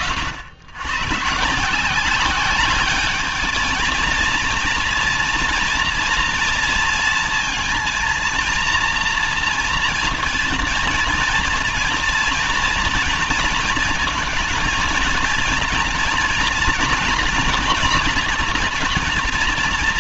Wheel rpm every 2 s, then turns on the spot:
110, 200, 230, 230, 230, 230, 230, 230, 230, 230.
none